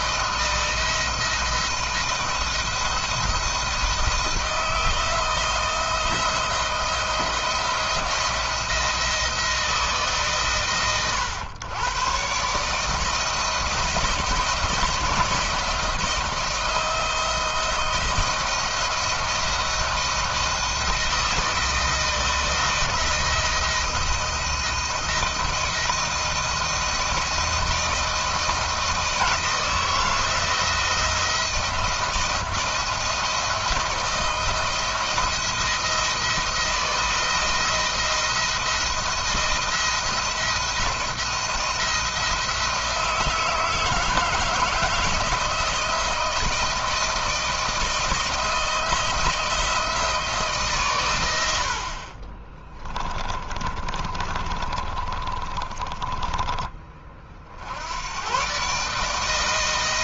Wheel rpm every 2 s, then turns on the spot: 170, 160, 160, 170, 170, 130, 140, 170, 160, 170, 160, 160, 160, 160, 160, 170, 170, 170, 170, 170, 170, 170, 160, 160, 160, 150, 30, 30, 20, 130.
52-58